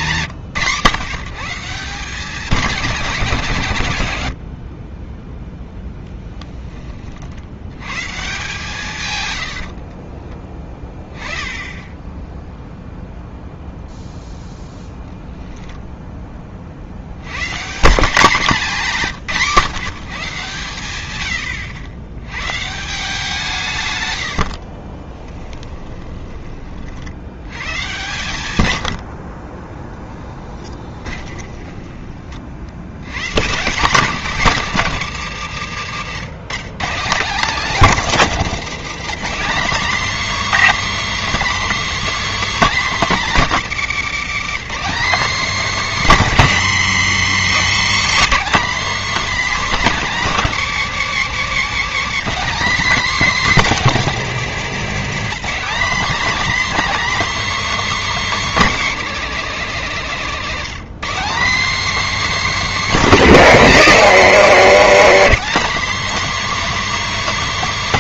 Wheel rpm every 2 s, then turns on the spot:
130, 190, 50, 20, 130, 20, 0, 0, 40, 200, 140, 130, 50, 40, 100, 10, 70, 200, 170, 200, 310, 280, 230, 200, 260, 230, 260, 230, 290, 260, 210, 270, 210, 300.
4-6 24-26 28-32